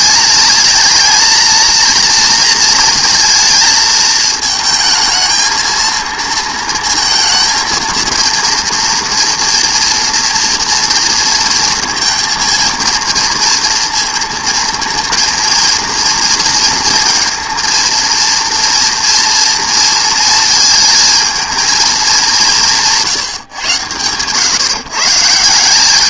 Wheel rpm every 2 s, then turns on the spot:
220, 240, 220, 220, 230, 240, 230, 230, 230, 230, 230, 190, 130.
none